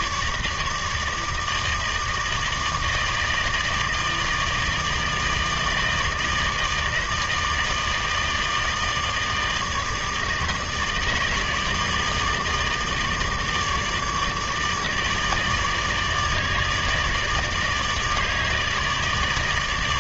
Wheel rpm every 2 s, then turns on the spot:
160, 160, 160, 160, 160, 160, 160, 160, 150, 150.
none